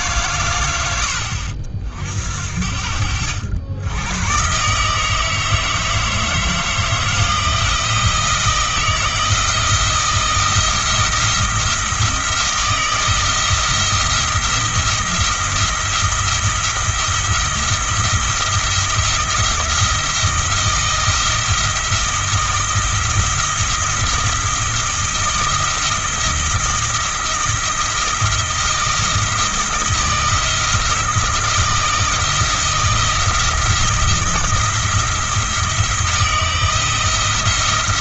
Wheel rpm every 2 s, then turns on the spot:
90, 60, 150, 160, 170, 170, 170, 160, 170, 170, 170, 170, 160, 160, 170, 170, 170, 170, 170.
none